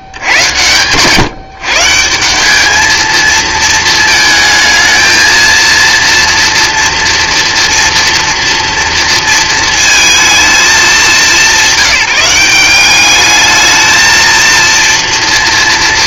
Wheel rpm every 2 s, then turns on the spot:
130, 210, 220, 230, 230, 220, 190, 230.
none